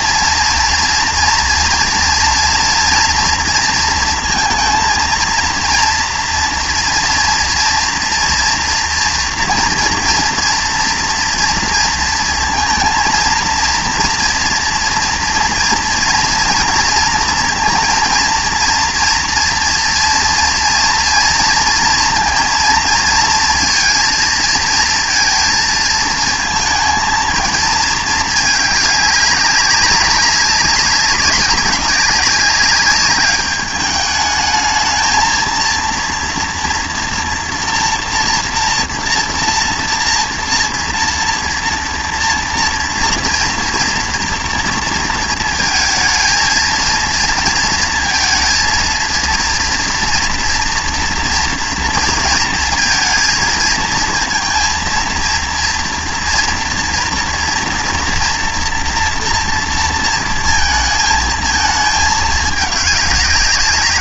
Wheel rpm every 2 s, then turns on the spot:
230, 230, 230, 240, 230, 230, 230, 230, 230, 230, 230, 230, 230, 220, 210, 200, 200, 210, 230, 230, 230, 230, 240, 230, 230, 230, 230, 230, 230, 240, 220, 210.
none